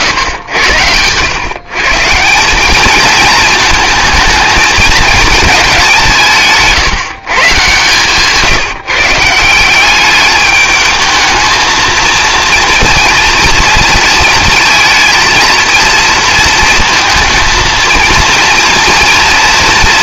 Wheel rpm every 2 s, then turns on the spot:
100, 200, 220, 160, 160, 210, 230, 220, 230, 230.
none